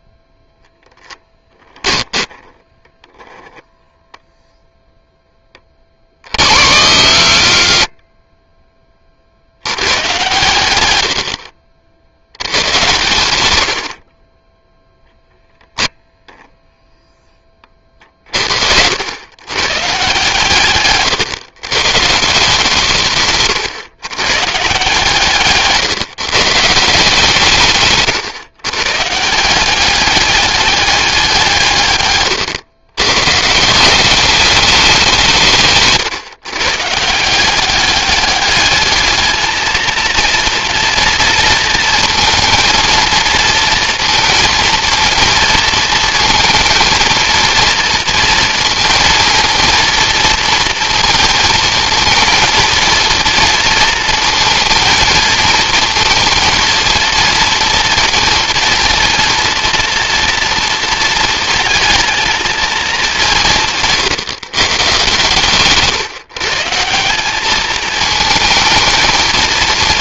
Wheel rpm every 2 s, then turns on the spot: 0, 10, 0, 60, 40, 70, 110, 0, 20, 100, 130, 150, 150, 160, 150, 190, 130, 170, 170, 220, 230, 230, 230, 230, 230, 230, 230, 230, 230, 230, 220, 190, 140, 190, 220.
2-4 10-12